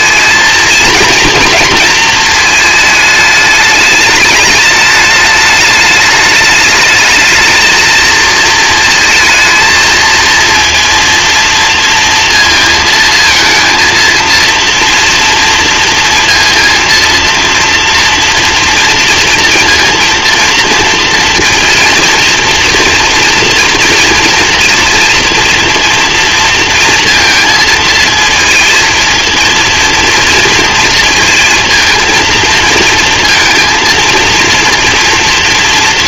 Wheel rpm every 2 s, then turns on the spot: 230, 220, 210, 210, 230, 230, 230, 230, 230, 230, 230, 240, 230, 230, 230, 230, 230, 230.
none